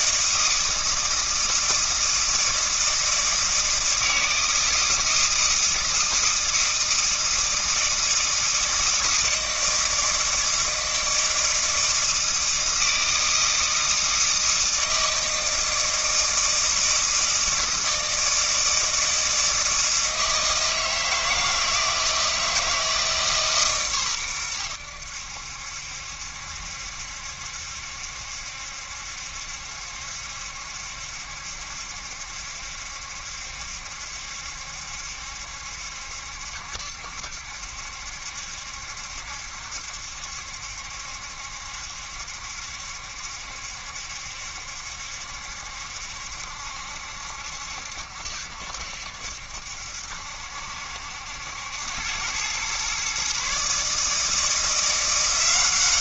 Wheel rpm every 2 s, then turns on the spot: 160, 160, 160, 160, 160, 160, 160, 160, 160, 160, 160, 160, 90, 70, 70, 70, 70, 70, 70, 70, 70, 70, 70, 70, 70, 70, 120, 170.
none